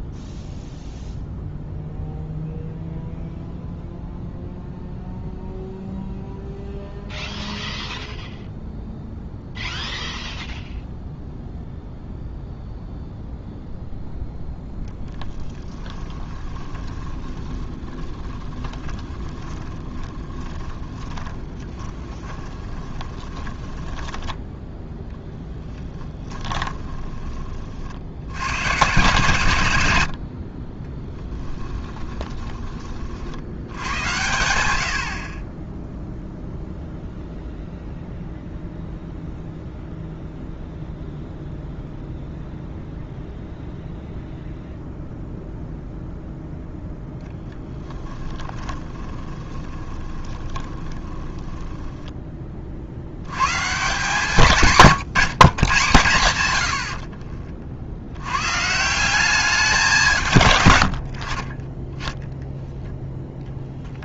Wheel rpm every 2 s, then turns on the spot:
0, 0, 0, 0, 0, 0, 0, 0, 20, 20, 20, 20, 10, 20, 120, 30, 20, 80, 0, 0, 0, 0, 0, 10, 20, 20, 50, 140, 70, 170, 100, 0.
16-24 26-28 48-52 56-58